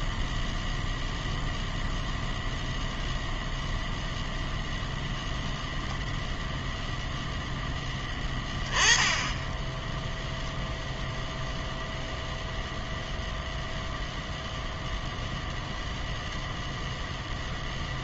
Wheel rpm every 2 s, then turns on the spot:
0, 0, 0, 0, 10, 0, 0, 0, 0.
none